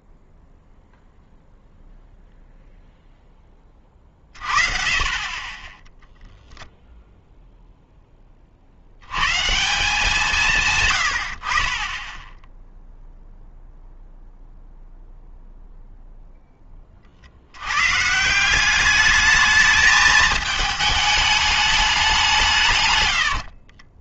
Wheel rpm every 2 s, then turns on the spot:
0, 0, 30, 0, 50, 130, 10, 0, 20, 190, 220, 150.
none